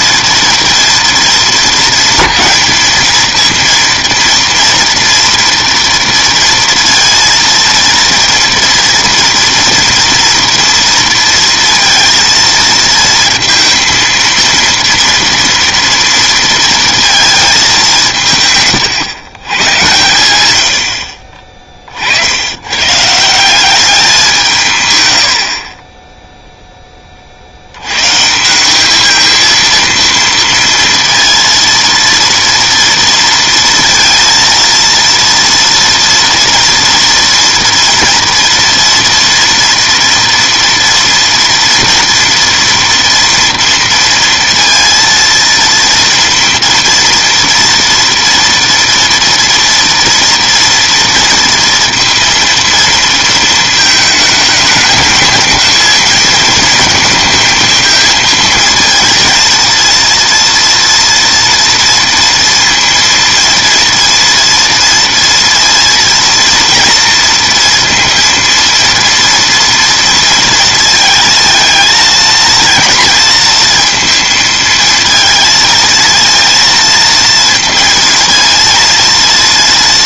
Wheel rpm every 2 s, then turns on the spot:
230, 220, 230, 230, 230, 230, 230, 230, 230, 130, 80, 120, 140, 10, 180, 230, 230, 230, 230, 230, 230, 230, 230, 230, 230, 230, 230, 220, 220, 220, 230, 230, 230, 230, 230, 230, 230, 230, 230, 230.
none